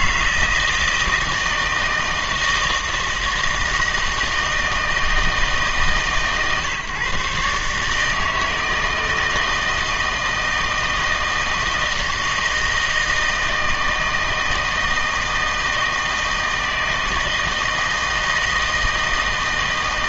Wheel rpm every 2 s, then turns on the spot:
160, 160, 160, 140, 160, 160, 160, 160, 160, 160.
none